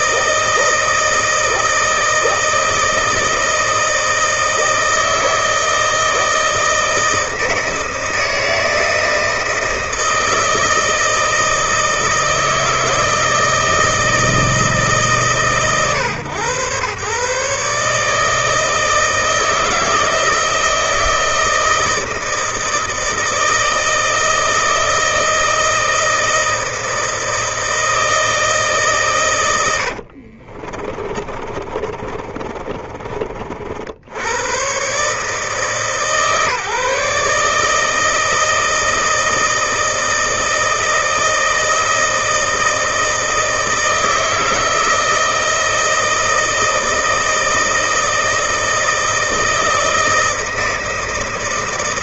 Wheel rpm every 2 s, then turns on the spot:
160, 160, 160, 160, 160, 160, 160, 130, 130, 160, 160, 160, 160, 160, 100, 30, 40, 130, 140, 160, 160, 160, 160, 160, 160, 160.
28-34